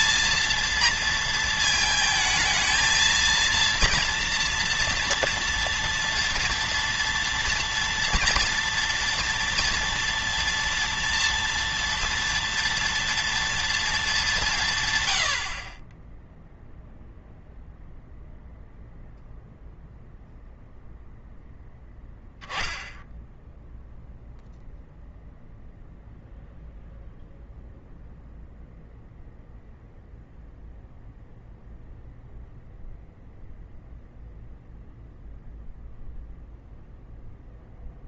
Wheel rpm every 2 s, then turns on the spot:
230, 230, 230, 230, 230, 230, 230, 130, 0, 0, 0, 10, 0, 0, 0, 0, 0, 0, 0.
none